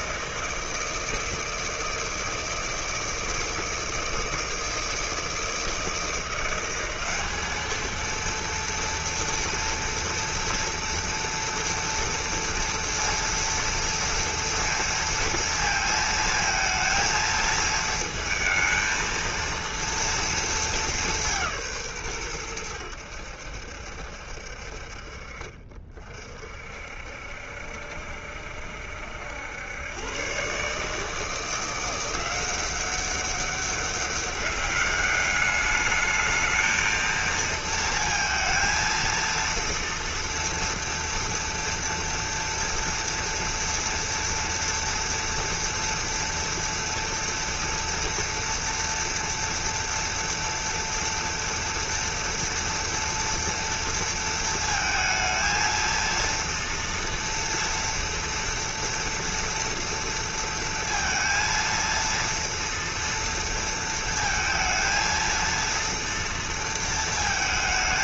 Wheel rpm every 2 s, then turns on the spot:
160, 160, 160, 200, 230, 230, 230, 230, 230, 230, 190, 80, 40, 70, 80, 160, 190, 200, 230, 230, 240, 230, 230, 240, 240, 240, 230, 220, 230, 230, 230, 230, 230, 220.
none